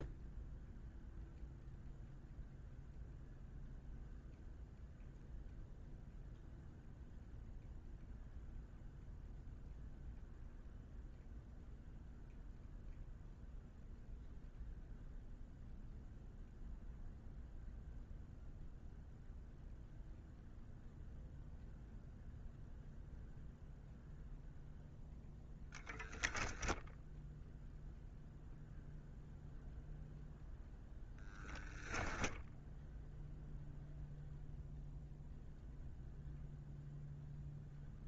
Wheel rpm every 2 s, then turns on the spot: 0, 0, 0, 0, 0, 0, 0, 0, 0, 0, 0, 0, 0, 0, 0, 0, 0, 0, 0.
none